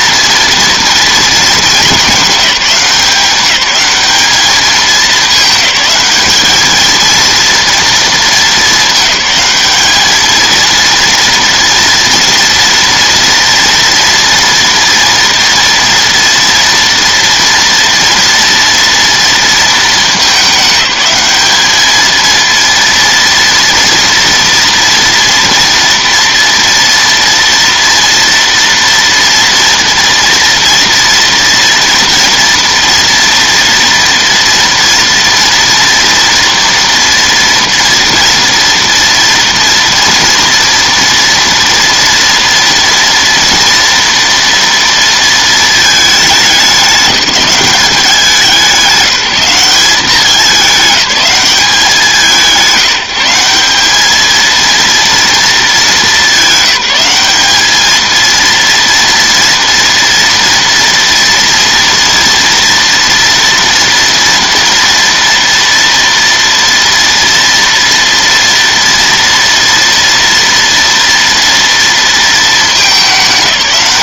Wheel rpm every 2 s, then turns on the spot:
230, 200, 210, 220, 220, 230, 230, 230, 230, 230, 210, 230, 230, 230, 230, 240, 240, 230, 230, 230, 230, 230, 230, 210, 190, 210, 170, 230, 200, 230, 230, 230, 230, 230, 230, 230, 220.
none